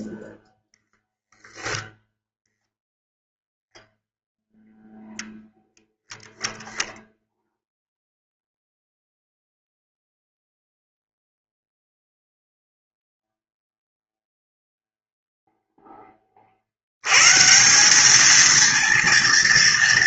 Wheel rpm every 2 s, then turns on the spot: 0, 0, 0, 0, 0, 0, 0, 0, 40, 220.
none